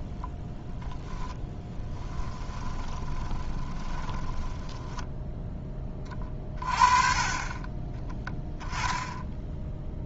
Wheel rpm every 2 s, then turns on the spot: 0, 20, 10, 40, 10.
2-6